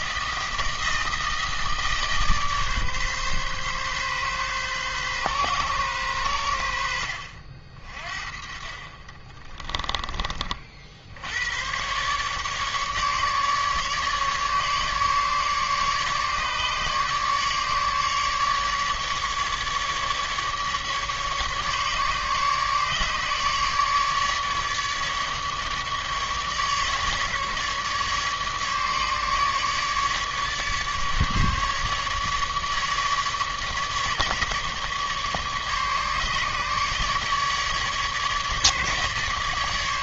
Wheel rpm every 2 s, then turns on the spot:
160, 150, 140, 90, 40, 40, 140, 150, 150, 150, 150, 150, 150, 150, 150, 150, 150, 150, 150, 150.
none